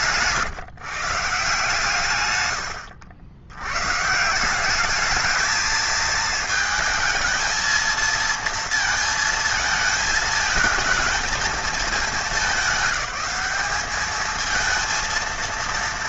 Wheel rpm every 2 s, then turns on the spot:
140, 120, 180, 230, 230, 220, 210, 220.
none